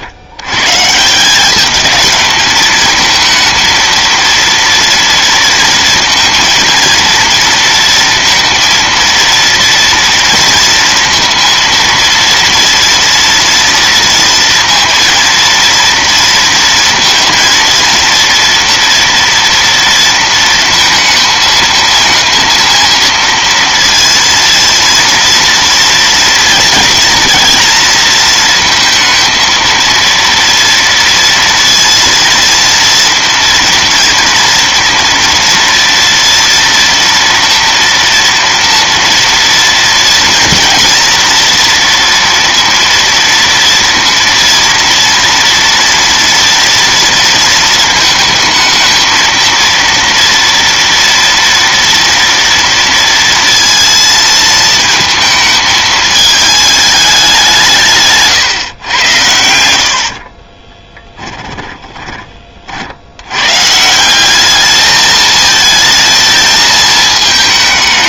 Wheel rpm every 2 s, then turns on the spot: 210, 230, 230, 230, 230, 230, 230, 230, 230, 230, 220, 230, 230, 240, 230, 230, 230, 230, 230, 230, 230, 230, 230, 220, 230, 230, 230, 220, 150, 70, 20, 160, 220, 220.
60-62